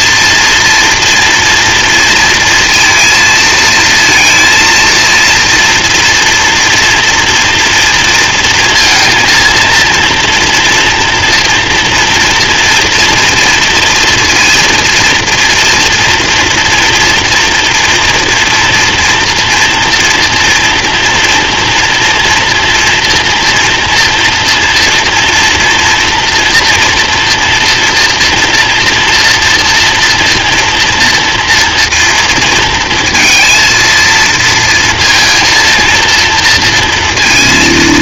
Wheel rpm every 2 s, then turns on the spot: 230, 230, 230, 230, 230, 240, 230, 230, 240, 230, 230, 230, 230, 230, 230, 230, 230, 230, 230.
none